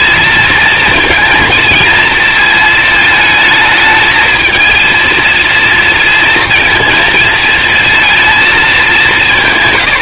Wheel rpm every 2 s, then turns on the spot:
230, 220, 230, 230, 170.
none